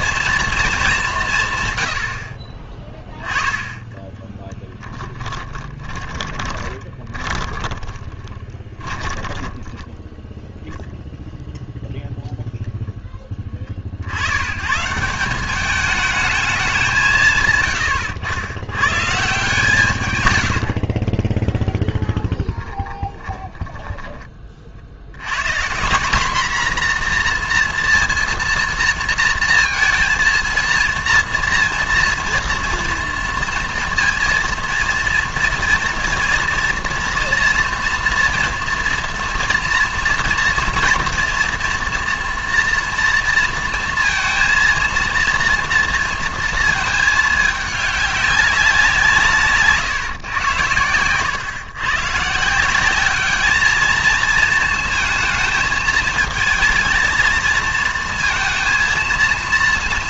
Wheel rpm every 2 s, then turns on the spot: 220, 20, 20, 30, 20, 0, 0, 130, 190, 110, 70, 20, 50, 240, 230, 230, 240, 230, 230, 230, 230, 230, 230, 220, 180, 110, 170, 220, 220, 230.
4-10 20-24